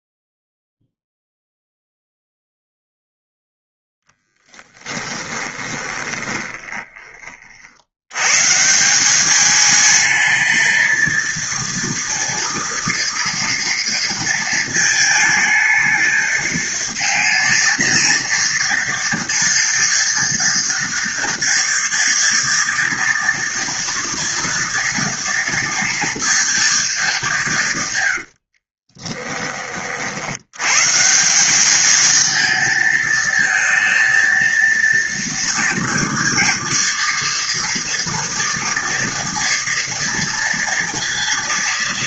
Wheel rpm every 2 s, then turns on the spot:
0, 0, 20, 30, 190, 230, 240, 220, 220, 230, 230, 230, 230, 210, 20, 150, 220, 230, 230, 230, 230.
4-6 28-30